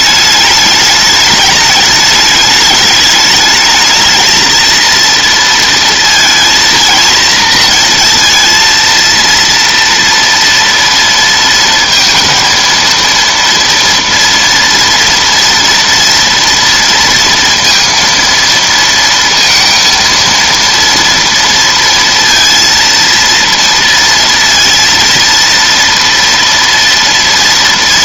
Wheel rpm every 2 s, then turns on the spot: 210, 210, 230, 230, 230, 230, 230, 240, 230, 230, 230, 230, 230, 230.
none